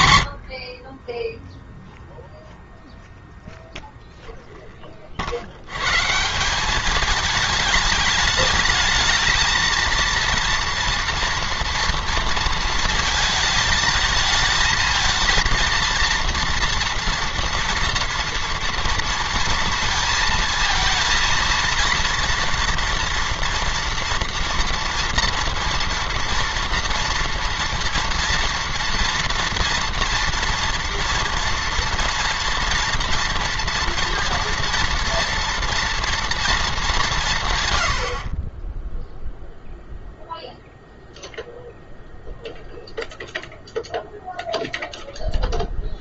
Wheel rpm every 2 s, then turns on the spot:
50, 0, 20, 190, 220, 230, 230, 220, 230, 230, 230, 240, 240, 240, 230, 230, 230, 230, 200, 10, 0, 0, 0.
none